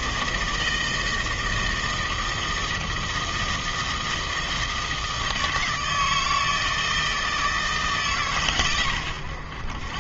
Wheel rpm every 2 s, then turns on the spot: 160, 160, 160, 160, 130.
none